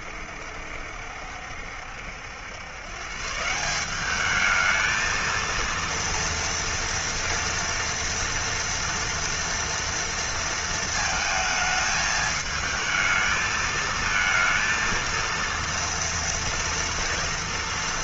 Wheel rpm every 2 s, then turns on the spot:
70, 90, 200, 230, 230, 230, 220, 230, 230.
none